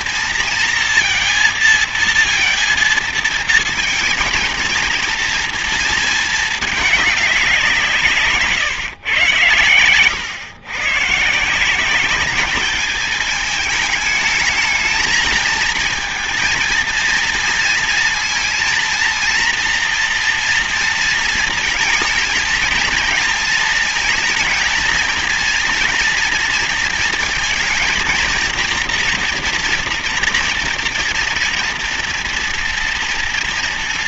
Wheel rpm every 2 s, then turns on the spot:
230, 230, 230, 210, 120, 130, 210, 220, 230, 230, 230, 230, 230, 230, 230, 230, 230.
none